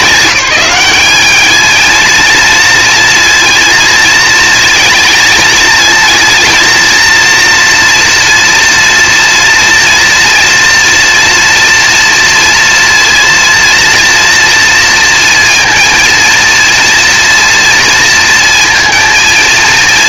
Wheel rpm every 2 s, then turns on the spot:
200, 230, 220, 230, 230, 230, 230, 230, 240, 230.
none